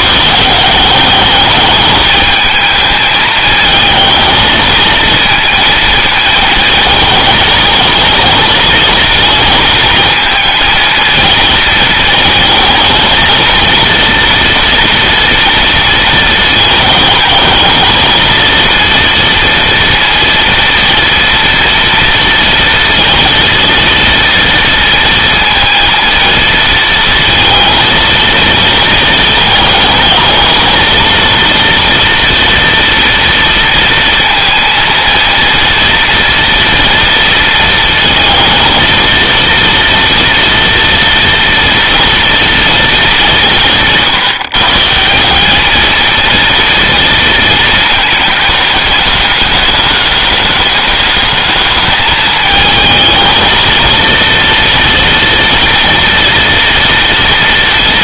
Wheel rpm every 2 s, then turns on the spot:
190, 220, 230, 220, 220, 220, 230, 230, 220, 230, 230, 230, 230, 230, 230, 230, 230, 230, 230, 230, 230, 230, 180, 230, 210, 220, 220, 240, 230.
none